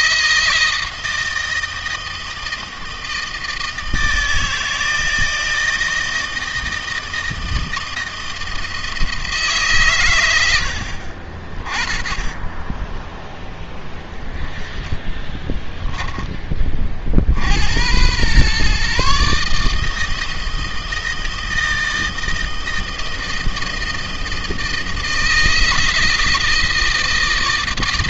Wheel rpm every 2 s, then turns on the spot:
160, 160, 160, 160, 160, 80, 20, 20, 30, 130, 160, 160, 160, 160.
14-16